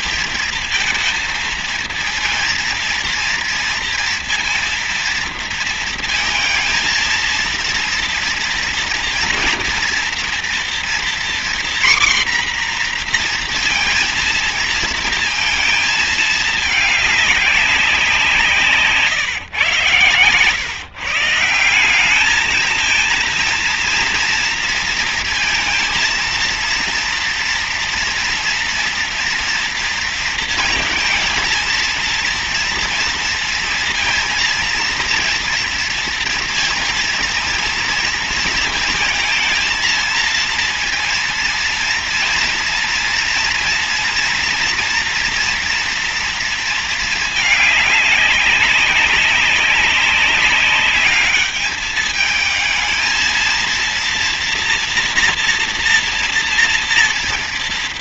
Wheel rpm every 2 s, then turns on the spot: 230, 230, 230, 230, 230, 240, 250, 230, 220, 170, 130, 220, 230, 230, 230, 230, 230, 230, 230, 230, 230, 230, 230, 230, 200, 200, 220, 230, 230.
none